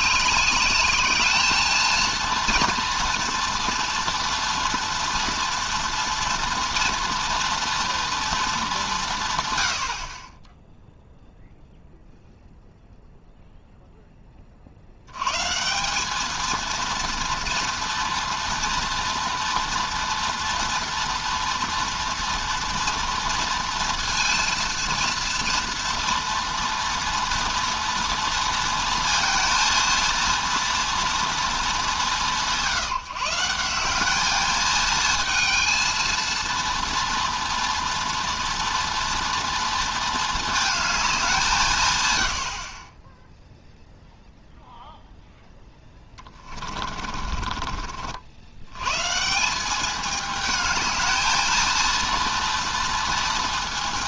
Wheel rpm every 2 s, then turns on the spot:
200, 230, 230, 230, 200, 0, 0, 60, 230, 240, 240, 240, 230, 230, 230, 230, 170, 220, 230, 240, 220, 40, 0, 30, 110, 220, 230.
46-48